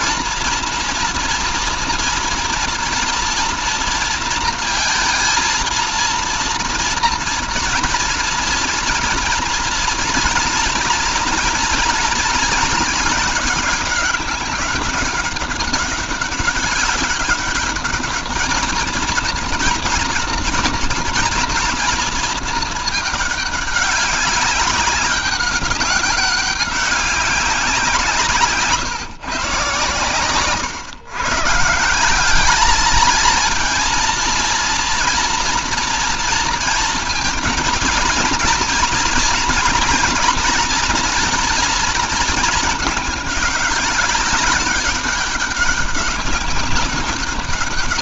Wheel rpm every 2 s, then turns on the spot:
240, 230, 230, 230, 230, 230, 220, 200, 200, 220, 230, 220, 200, 200, 150, 130, 210, 230, 230, 230, 240, 220, 190, 190.
none